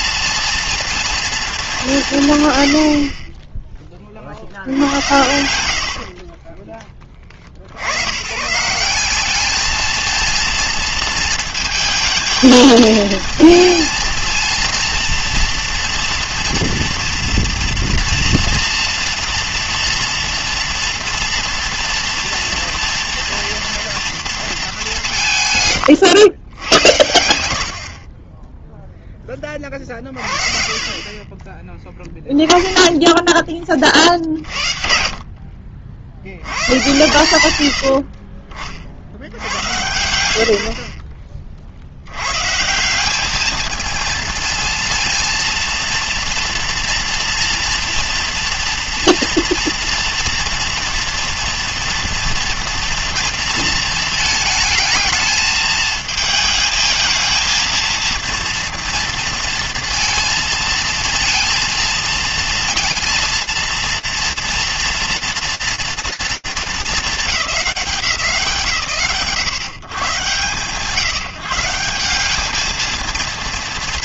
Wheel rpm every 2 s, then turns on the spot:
230, 110, 70, 20, 160, 230, 220, 230, 230, 230, 230, 230, 210, 110, 0, 40, 10, 60, 110, 40, 70, 160, 220, 230, 230, 230, 230, 220, 220, 230, 230, 230, 230, 210, 120, 170, 180.
6-8 32-36